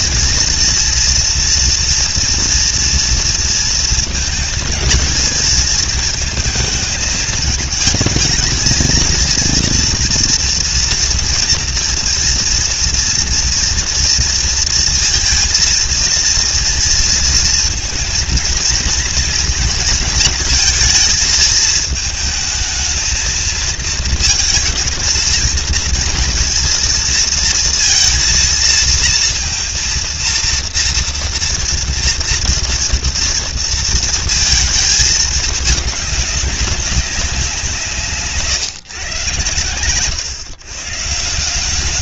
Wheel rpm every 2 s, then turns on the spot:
230, 230, 220, 220, 220, 240, 230, 230, 230, 230, 230, 220, 220, 230, 230, 230, 230, 220, 200, 140, 140.
none